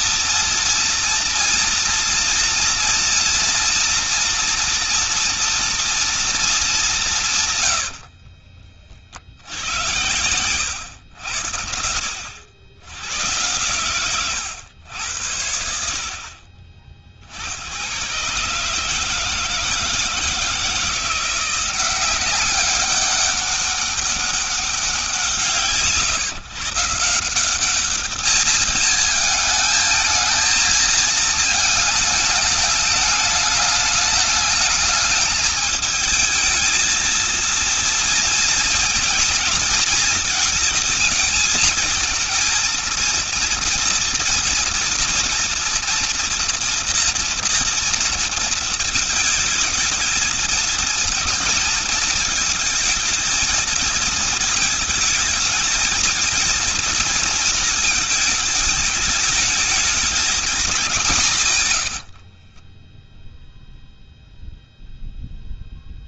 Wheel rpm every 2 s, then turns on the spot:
230, 230, 230, 200, 40, 100, 100, 90, 30, 150, 160, 200, 190, 150, 220, 220, 210, 210, 220, 230, 230, 230, 230, 230, 230, 220, 220, 220, 230, 220, 210, 30, 0.
62-64